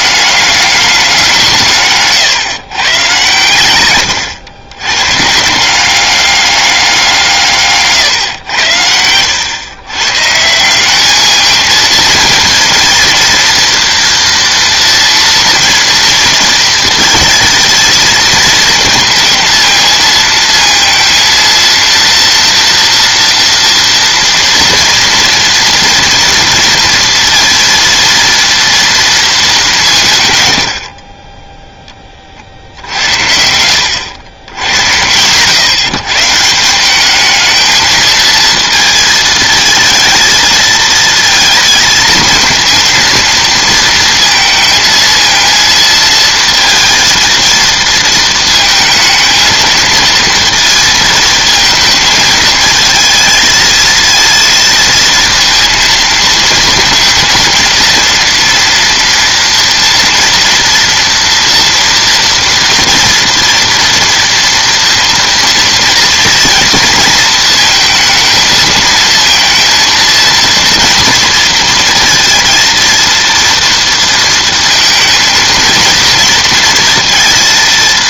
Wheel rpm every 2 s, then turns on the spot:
200, 130, 110, 190, 100, 180, 230, 230, 230, 220, 230, 230, 230, 230, 230, 100, 60, 90, 180, 230, 230, 230, 220, 220, 220, 230, 220, 230, 220, 230, 230, 230, 230, 230, 220, 230, 230, 230, 230.
none